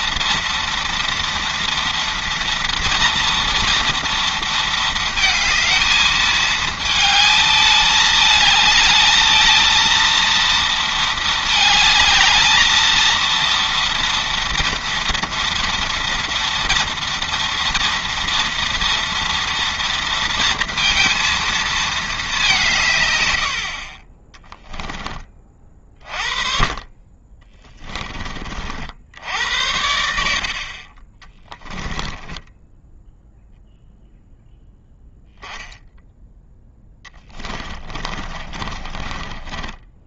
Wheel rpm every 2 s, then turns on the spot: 230, 230, 230, 220, 220, 220, 220, 230, 230, 230, 230, 180, 10, 40, 70, 30, 10, 0, 10, 20.
30-34 36-40